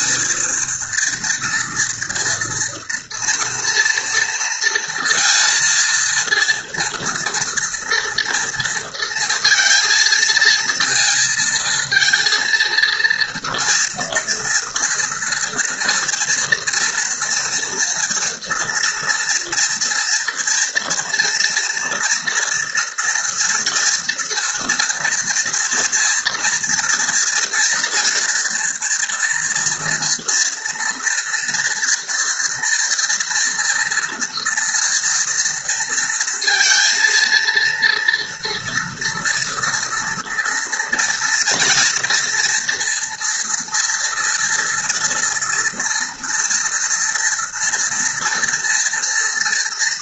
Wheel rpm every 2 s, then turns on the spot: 230, 240, 230, 230, 230, 230, 230, 230, 230, 230, 230, 230, 230, 230, 240, 240, 230, 240, 230, 230, 240, 240, 230, 230, 230.
none